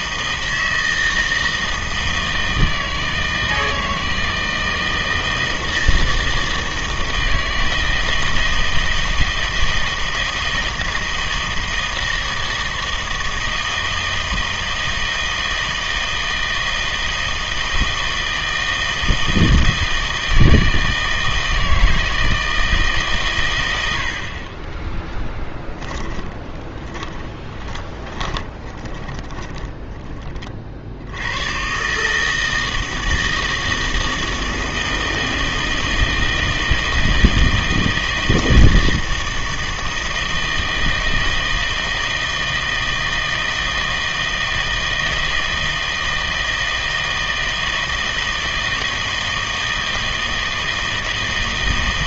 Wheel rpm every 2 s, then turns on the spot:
160, 160, 160, 160, 160, 160, 160, 160, 160, 160, 160, 160, 20, 20, 20, 40, 160, 160, 160, 160, 160, 160, 160, 160, 160, 160.
26-30